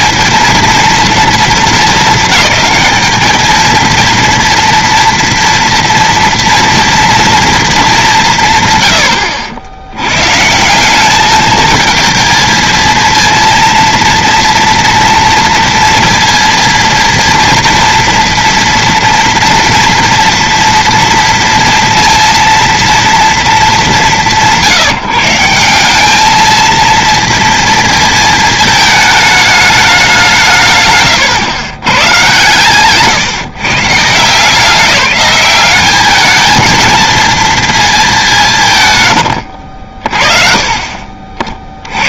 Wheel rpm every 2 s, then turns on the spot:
220, 210, 240, 230, 160, 140, 220, 230, 230, 230, 230, 230, 160, 220, 220, 160, 140, 180, 220, 170, 30.
none